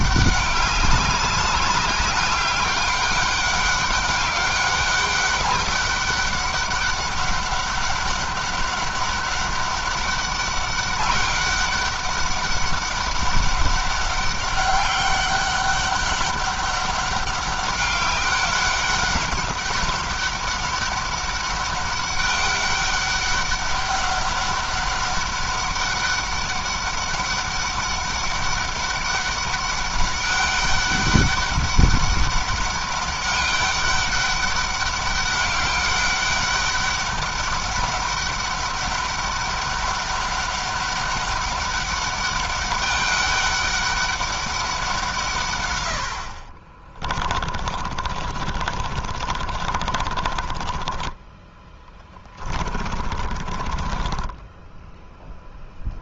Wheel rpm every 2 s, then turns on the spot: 200, 200, 200, 200, 200, 200, 200, 200, 200, 200, 200, 200, 200, 200, 200, 200, 200, 200, 200, 200, 200, 200, 180, 40, 40, 20, 40, 0.
46-54